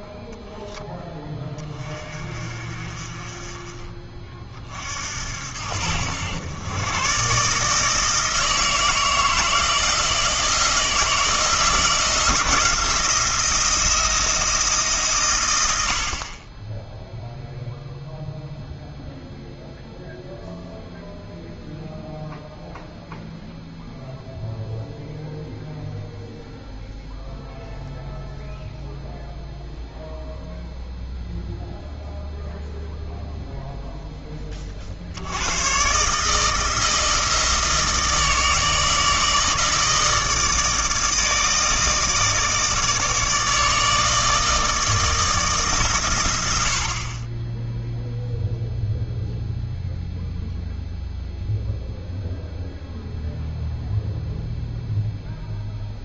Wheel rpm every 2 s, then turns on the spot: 10, 40, 50, 110, 160, 160, 170, 160, 10, 0, 0, 0, 0, 0, 0, 0, 0, 50, 160, 160, 160, 160, 160, 70, 0, 0, 0, 0.
none